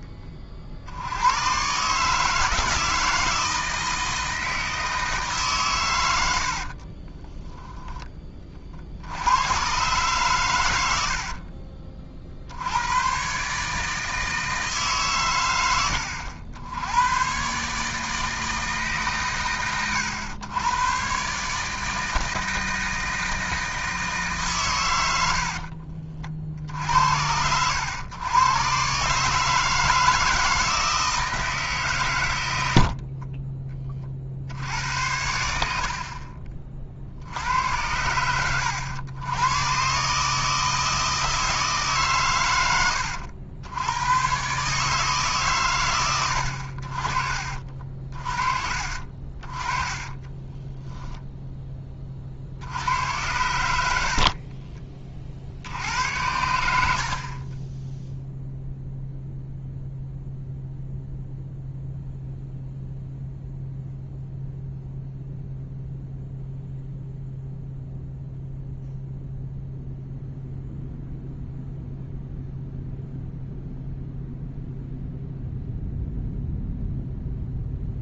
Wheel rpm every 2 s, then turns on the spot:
50, 160, 160, 50, 40, 110, 80, 160, 90, 160, 120, 160, 130, 40, 120, 160, 50, 70, 30, 80, 160, 100, 130, 60, 40, 20, 70, 40, 80, 0, 0, 0, 0, 0, 0, 0, 0, 0, 0.
6-8 50-52 54-56